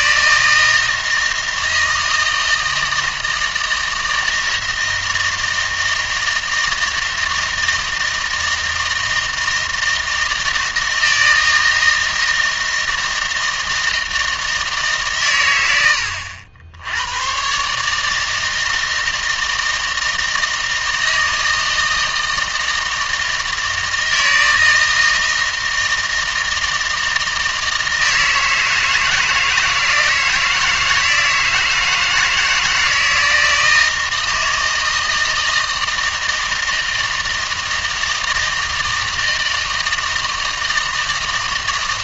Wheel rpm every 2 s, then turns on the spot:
160, 160, 160, 160, 160, 160, 160, 160, 90, 160, 160, 160, 160, 160, 160, 160, 160, 160, 160, 160, 160.
none